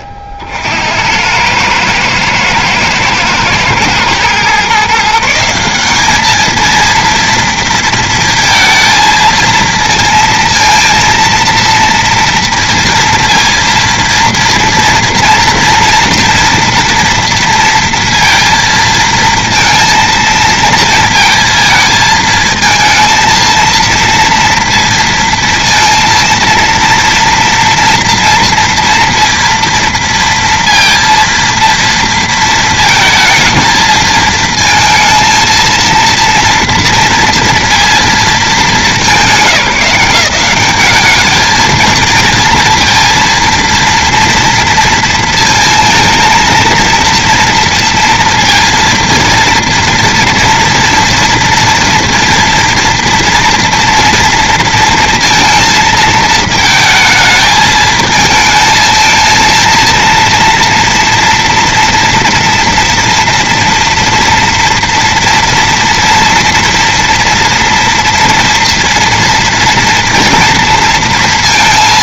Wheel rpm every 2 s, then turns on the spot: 70, 110, 130, 220, 230, 230, 230, 230, 230, 230, 230, 220, 230, 230, 230, 230, 230, 220, 230, 200, 190, 230, 230, 230, 230, 230, 230, 230, 220, 220, 230, 240, 230, 230, 230, 230.
none